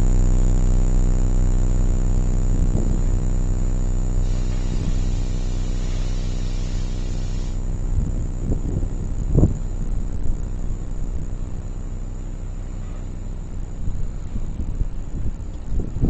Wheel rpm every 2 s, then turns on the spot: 0, 0, 0, 0, 0, 0, 0, 0.
none